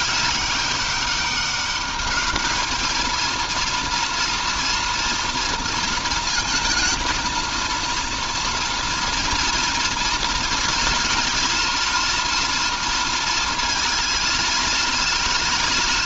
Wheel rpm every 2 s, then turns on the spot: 200, 220, 230, 230, 240, 230, 230, 220.
none